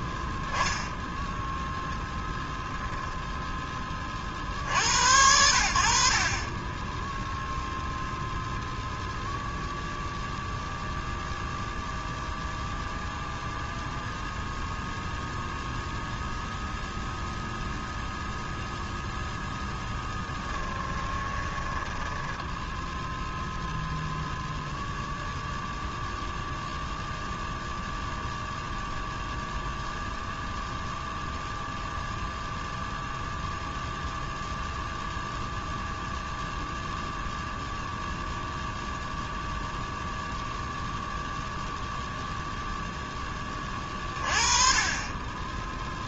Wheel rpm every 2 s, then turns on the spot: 0, 10, 60, 20, 0, 0, 0, 0, 0, 0, 10, 10, 0, 0, 0, 0, 0, 0, 0, 0, 0, 0, 30.
20-24